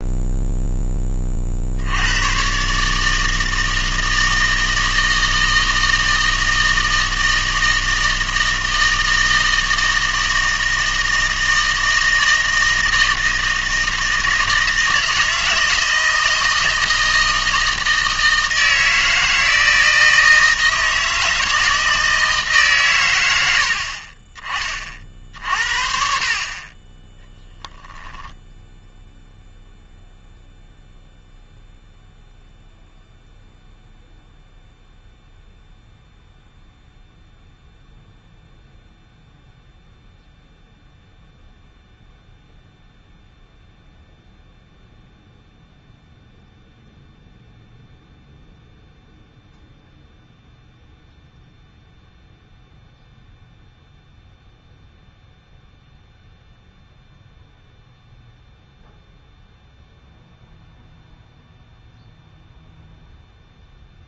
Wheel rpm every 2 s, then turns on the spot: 10, 150, 160, 160, 160, 160, 160, 160, 160, 160, 160, 140, 40, 30, 0, 0, 0, 0, 0, 0, 0, 0, 0, 0, 0, 0, 0, 0, 0, 0, 0, 0.
none